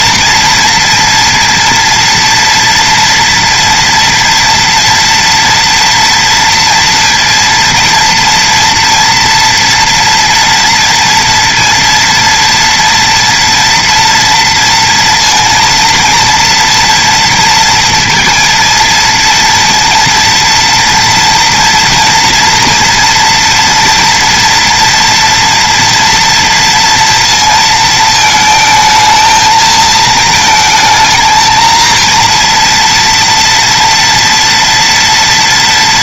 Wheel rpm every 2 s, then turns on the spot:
230, 230, 230, 230, 230, 230, 230, 230, 230, 230, 230, 240, 230, 230, 220, 220, 230, 230.
none